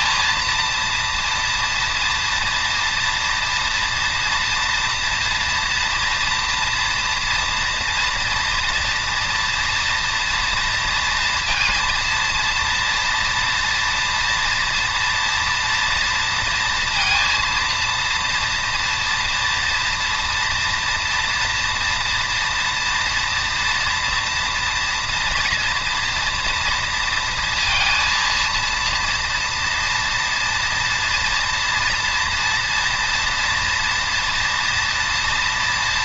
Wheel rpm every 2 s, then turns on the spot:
230, 240, 230, 240, 230, 230, 230, 230, 230, 230, 240, 230, 230, 230, 230, 230, 230, 230.
none